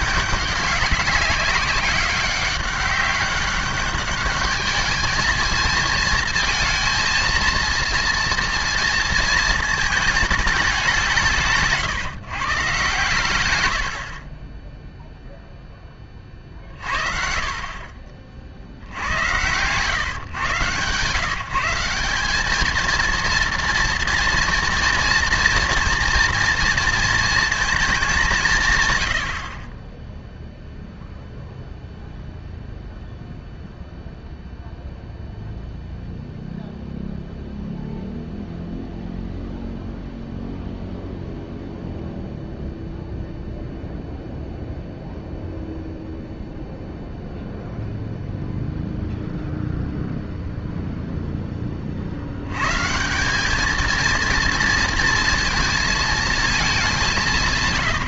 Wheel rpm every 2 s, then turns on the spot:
200, 200, 210, 230, 230, 200, 130, 20, 40, 50, 120, 210, 230, 230, 140, 0, 0, 0, 0, 0, 0, 0, 0, 0, 0, 0, 110, 240, 220.
14-16